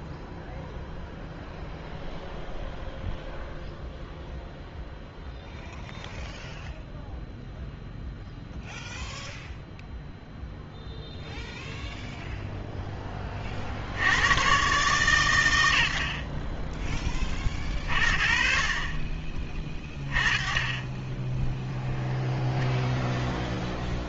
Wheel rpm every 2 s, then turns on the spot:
0, 0, 0, 0, 0, 0, 0, 120, 30, 50, 20, 0.
none